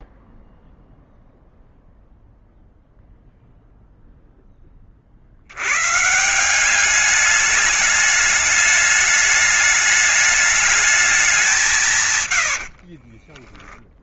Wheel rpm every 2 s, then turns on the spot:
0, 0, 40, 190, 210, 200, 60.
12-14